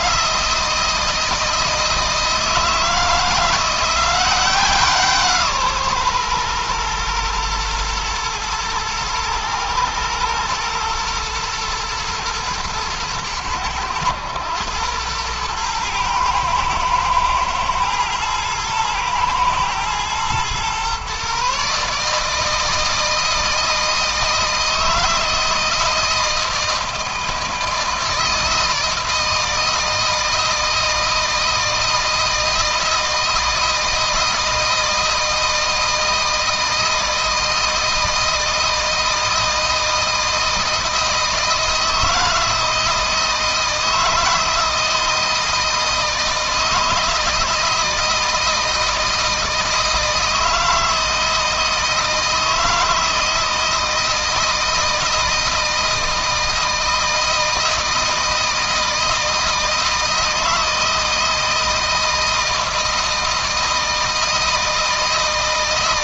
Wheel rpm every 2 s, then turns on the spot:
160, 160, 170, 120, 110, 120, 110, 100, 110, 110, 120, 160, 160, 160, 160, 160, 160, 160, 160, 160, 160, 160, 160, 160, 160, 160, 160, 160, 160, 160, 160, 160, 160.
none